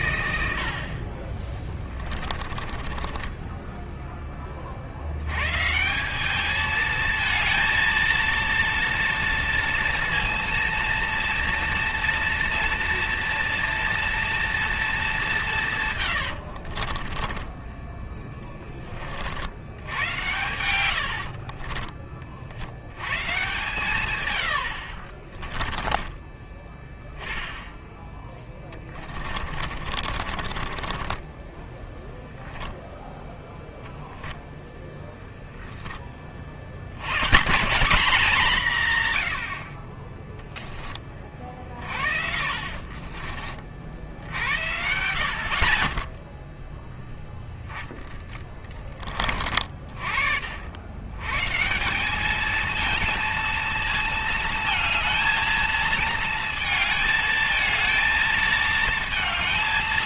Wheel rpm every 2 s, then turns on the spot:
50, 20, 70, 220, 230, 230, 230, 220, 50, 40, 90, 100, 70, 20, 20, 30, 0, 0, 100, 150, 20, 40, 80, 0, 20, 90, 220, 220, 220, 220.
2-4 16-18 20-22 24-26 28-32 42-44